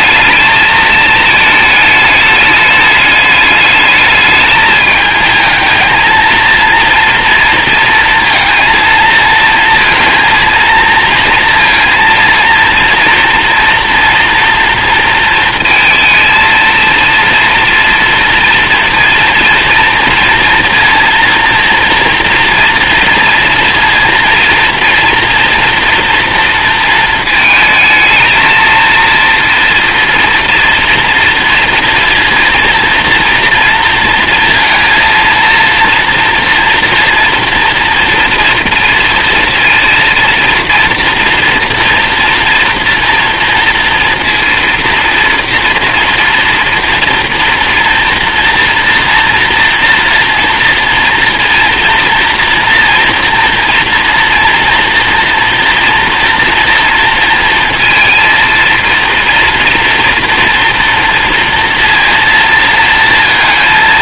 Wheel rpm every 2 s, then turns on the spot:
220, 210, 220, 230, 230, 230, 230, 230, 230, 230, 230, 230, 230, 220, 230, 230, 230, 230, 230, 230, 230, 240, 230, 230, 240, 230, 230, 230, 230, 230, 230, 230.
none